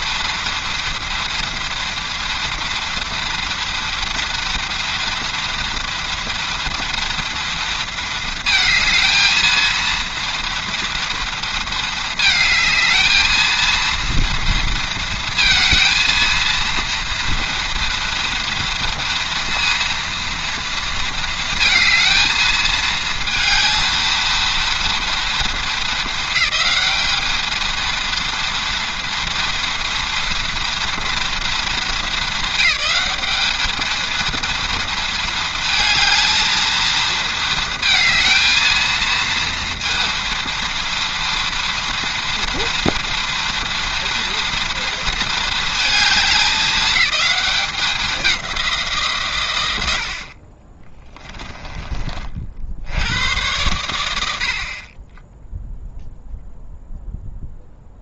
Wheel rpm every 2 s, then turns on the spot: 230, 230, 230, 230, 230, 230, 220, 230, 230, 230, 230, 230, 230, 220, 230, 230, 200, 230, 220, 230, 230, 230, 230, 210, 160, 20, 80, 20, 0.
50-52